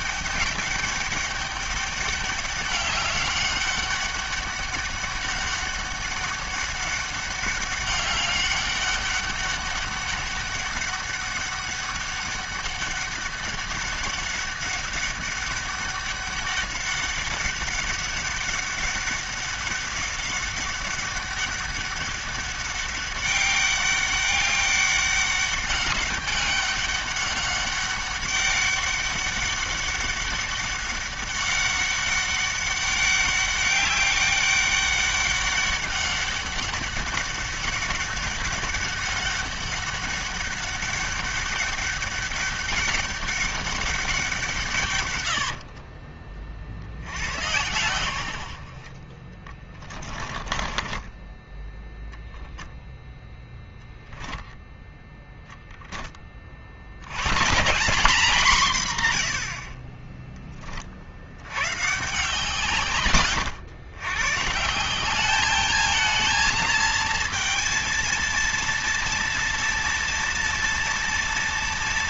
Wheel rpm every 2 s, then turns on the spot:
200, 200, 200, 200, 200, 200, 200, 200, 200, 200, 200, 200, 200, 200, 200, 200, 200, 200, 200, 200, 200, 200, 120, 80, 40, 20, 0, 0, 100, 140, 50, 100, 180, 230, 230, 230.
44-46 48-52